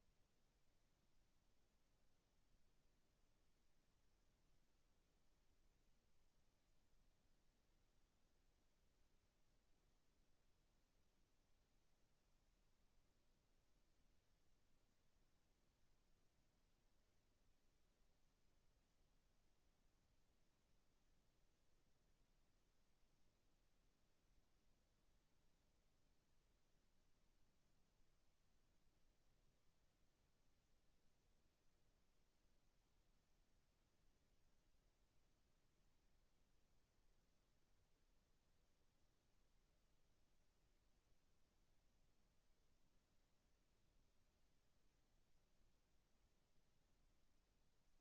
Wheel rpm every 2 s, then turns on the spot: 0, 0, 0, 0, 0, 0, 0, 0, 0, 0, 0, 0, 0, 0, 0, 0, 0, 0, 0, 0, 0, 0, 0, 0.
none